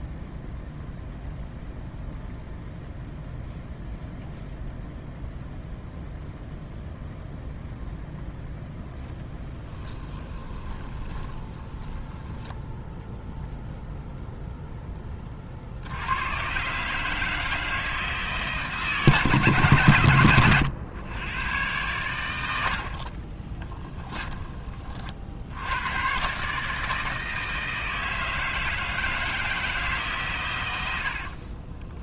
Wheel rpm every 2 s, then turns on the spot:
0, 0, 0, 0, 0, 20, 0, 10, 140, 150, 100, 60, 30, 150, 160, 90.
10-12 22-24